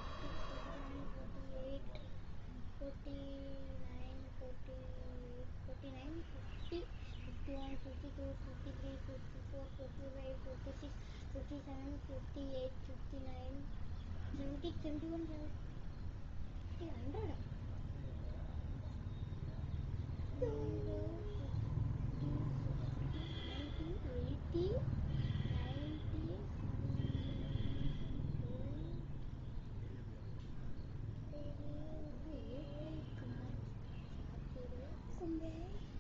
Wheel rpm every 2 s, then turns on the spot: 0, 0, 0, 0, 0, 0, 0, 0, 0, 0, 0, 0, 0, 0, 0, 0, 0, 0.
none